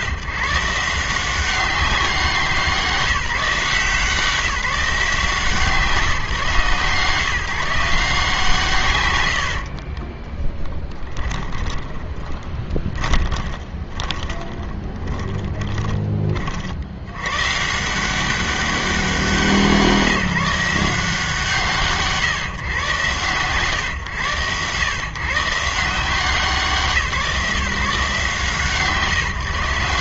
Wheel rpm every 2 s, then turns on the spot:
150, 170, 170, 160, 120, 10, 20, 20, 50, 190, 160, 130, 110, 160, 150.
10-16